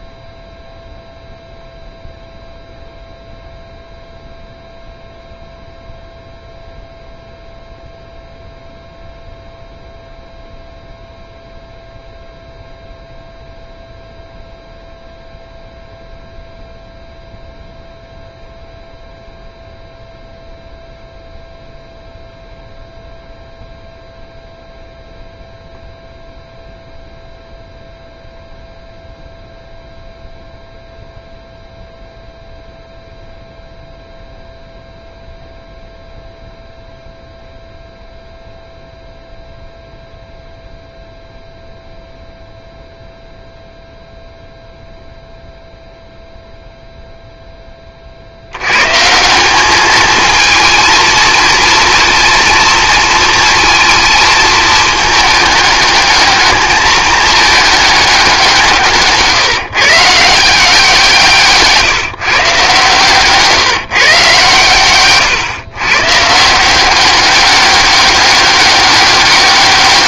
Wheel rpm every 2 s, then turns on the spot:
0, 0, 0, 0, 0, 0, 0, 0, 0, 0, 0, 0, 0, 0, 0, 0, 0, 0, 0, 0, 0, 0, 0, 0, 110, 220, 230, 220, 210, 160, 170, 140, 110, 180, 200.
none